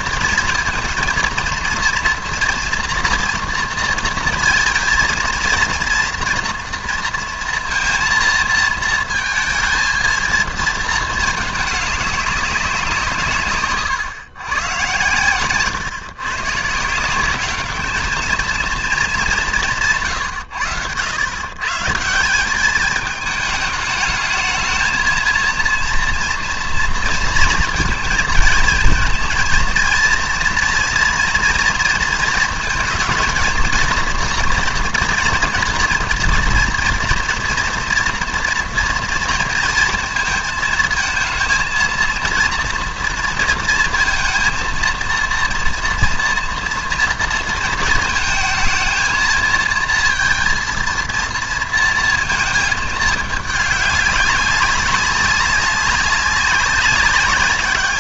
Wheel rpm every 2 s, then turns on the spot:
230, 230, 230, 230, 230, 220, 150, 130, 180, 210, 100, 220, 230, 230, 230, 230, 230, 240, 230, 230, 230, 230, 230, 230, 220, 230, 220, 200, 200.
none